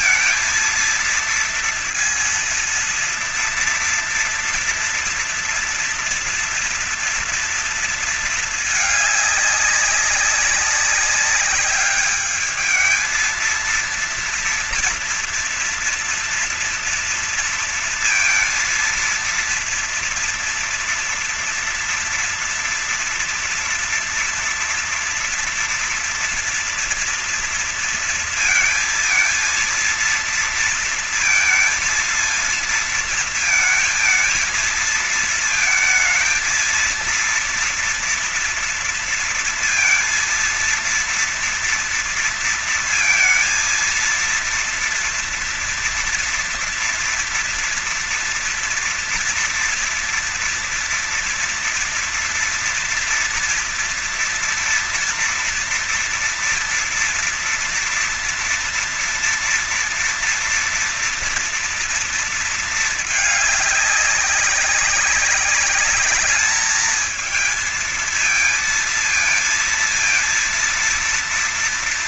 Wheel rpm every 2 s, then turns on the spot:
230, 230, 230, 230, 220, 190, 210, 230, 230, 230, 240, 230, 230, 230, 230, 230, 230, 220, 230, 230, 230, 230, 230, 240, 230, 230, 230, 240, 230, 230, 230, 230, 200, 210, 230, 230.
none